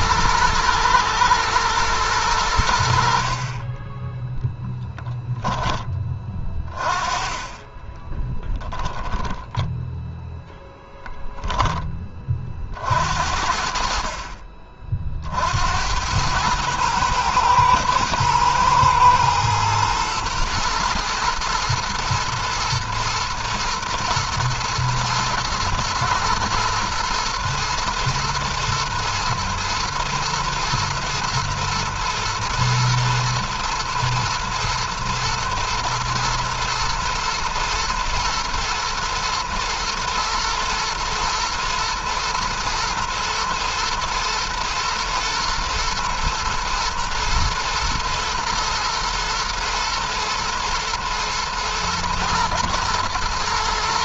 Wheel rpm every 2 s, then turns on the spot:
110, 80, 10, 30, 10, 0, 50, 40, 110, 120, 110, 120, 110, 120, 110, 110, 120, 120, 110, 120, 110, 110, 120, 110, 120, 120, 120.
4-6 8-10